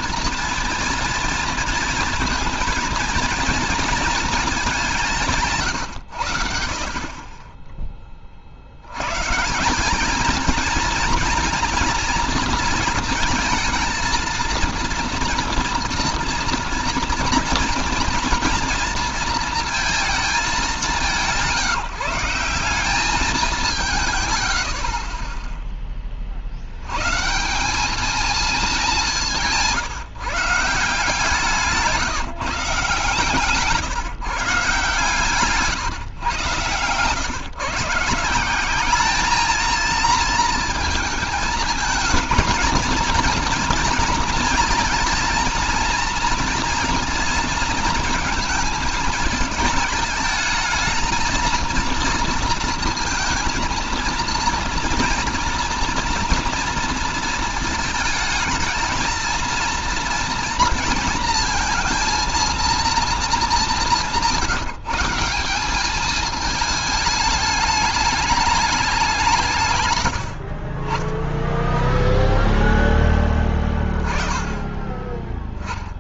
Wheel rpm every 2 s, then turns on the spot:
230, 230, 210, 80, 60, 220, 230, 230, 230, 230, 210, 170, 90, 70, 220, 170, 150, 150, 130, 180, 230, 230, 230, 230, 220, 220, 230, 230, 230, 220, 230, 230, 180, 220, 210, 70, 0, 10.
none